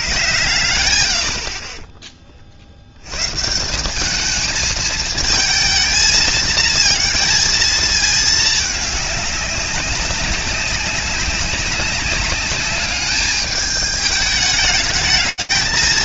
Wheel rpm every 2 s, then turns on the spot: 70, 30, 190, 230, 220, 190, 190, 210.
none